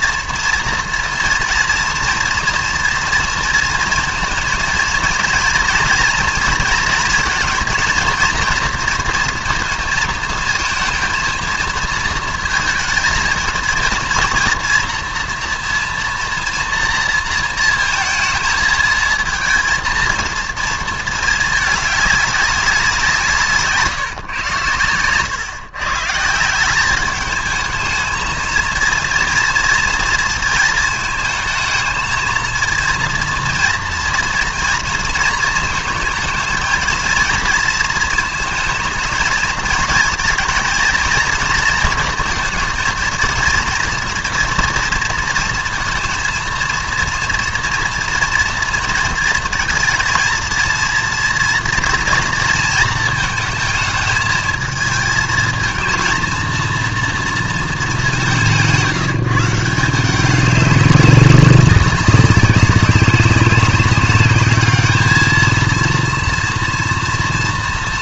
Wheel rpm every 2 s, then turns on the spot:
230, 230, 230, 230, 230, 220, 220, 240, 230, 230, 230, 180, 110, 180, 230, 220, 230, 230, 220, 220, 230, 230, 230, 230, 230, 230, 220, 220, 230, 180, 210, 200, 210, 230.
none